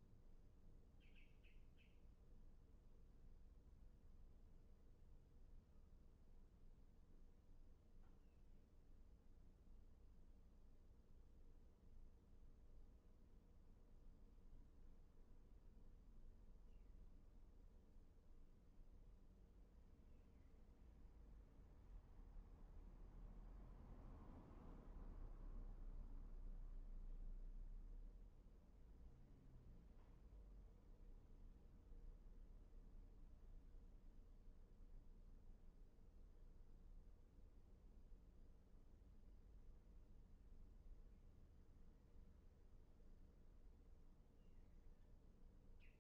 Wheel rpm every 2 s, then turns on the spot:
0, 0, 0, 0, 0, 0, 0, 0, 0, 0, 0, 0, 0, 0, 0, 0, 0, 0, 0, 0, 0, 0, 0.
none